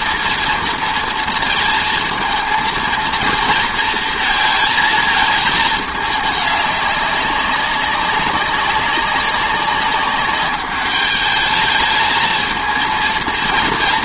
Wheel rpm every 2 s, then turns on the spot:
230, 230, 230, 200, 200, 200, 230.
none